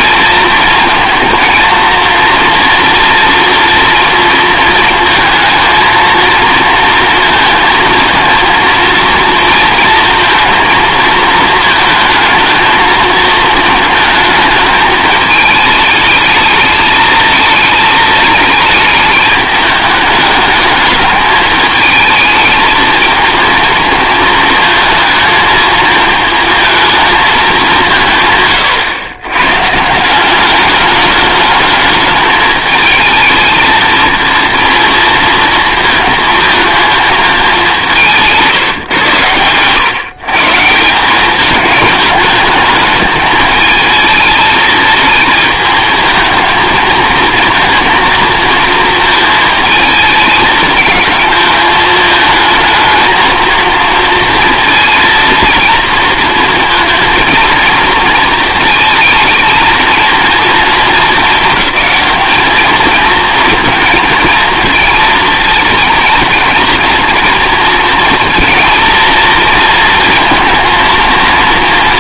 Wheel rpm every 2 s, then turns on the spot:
230, 240, 230, 230, 230, 220, 230, 210, 220, 220, 210, 220, 220, 220, 120, 200, 210, 230, 220, 140, 160, 210, 220, 230, 230, 220, 220, 230, 230, 220, 220, 220, 230, 230, 230, 230.
38-40